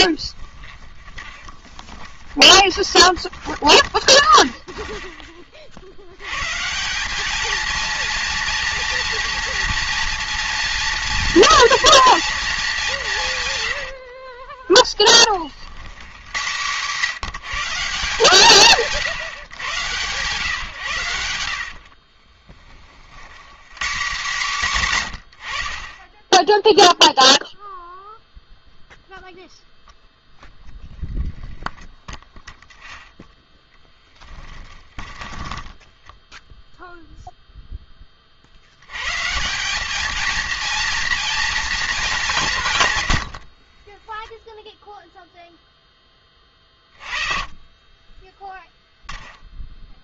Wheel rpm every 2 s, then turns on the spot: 20, 20, 60, 220, 230, 230, 80, 80, 170, 130, 60, 110, 70, 0, 0, 10, 0, 10, 0, 140, 230, 80, 0, 30, 0.
0-4 12-14 20-22 34-36 42-44